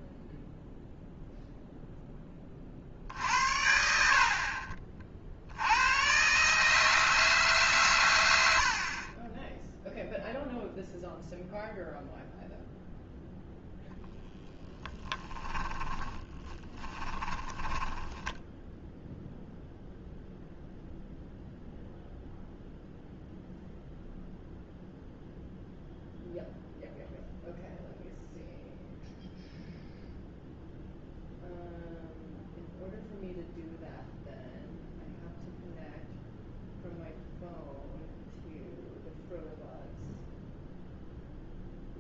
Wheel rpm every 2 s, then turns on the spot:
0, 40, 40, 150, 70, 0, 0, 10, 20, 0, 0, 0, 0, 0, 0, 0, 0, 0, 0, 0, 0.
14-18